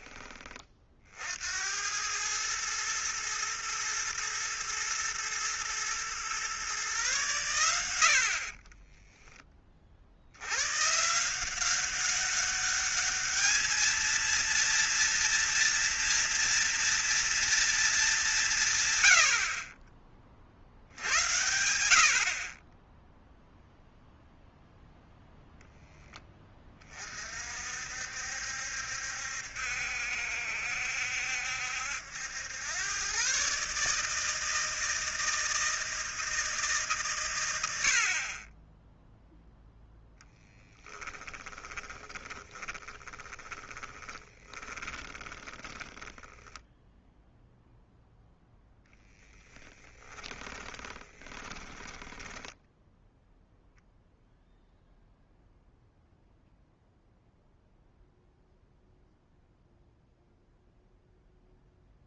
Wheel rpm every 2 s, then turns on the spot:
40, 110, 120, 130, 20, 120, 210, 230, 230, 130, 70, 10, 0, 40, 70, 70, 110, 160, 150, 10, 10, 20, 30, 0, 10, 20, 10, 0, 0, 0, 0.
8-10 40-46 50-52